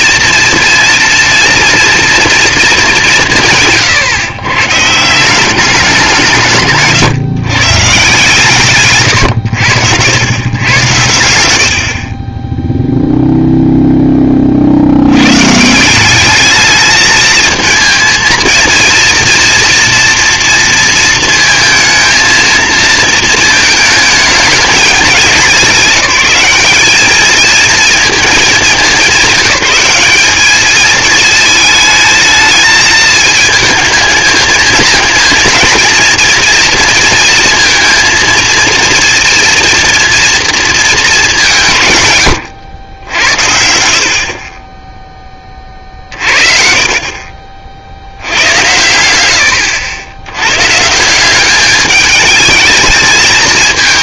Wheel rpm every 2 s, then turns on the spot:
230, 230, 120, 160, 130, 110, 20, 30, 210, 230, 230, 230, 210, 190, 220, 210, 220, 220, 230, 230, 230, 110, 30, 50, 80, 110, 210.
44-46